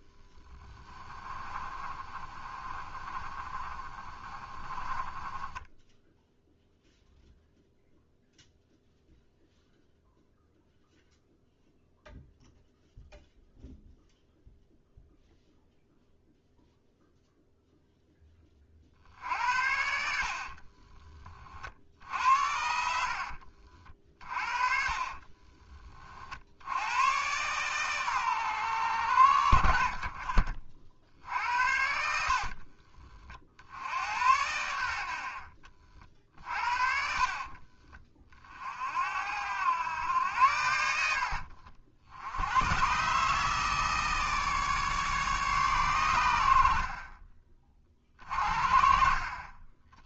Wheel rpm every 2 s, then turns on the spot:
20, 30, 30, 0, 0, 0, 0, 0, 0, 50, 40, 60, 40, 100, 90, 50, 40, 70, 50, 50, 80, 120, 150, 50, 40.
0-6 20-22 24-26 32-34 36-38